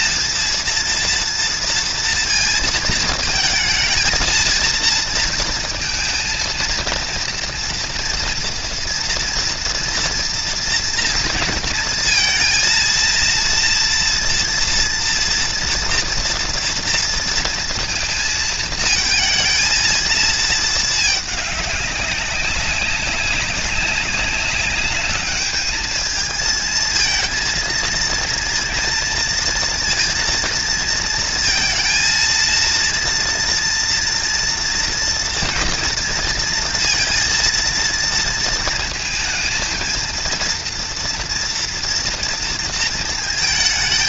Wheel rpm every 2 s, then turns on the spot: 230, 220, 230, 230, 230, 230, 230, 230, 230, 230, 220, 190, 210, 230, 230, 220, 230, 230, 230, 220, 230, 220.
none